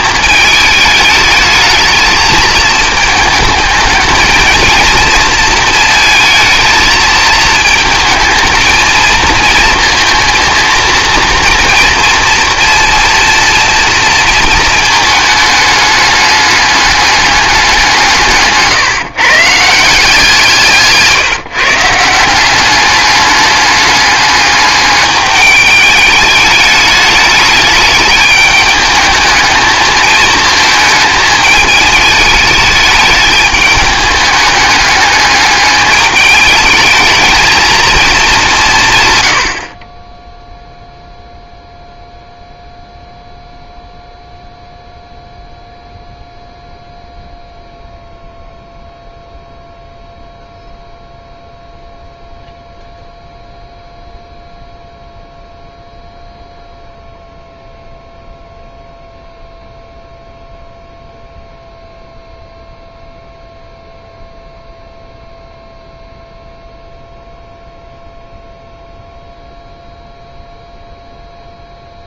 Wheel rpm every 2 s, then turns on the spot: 210, 220, 230, 220, 230, 230, 230, 220, 200, 150, 160, 200, 210, 210, 210, 220, 210, 210, 210, 160, 0, 0, 0, 0, 0, 0, 0, 0, 0, 0, 0, 0, 0, 0, 0, 0.
none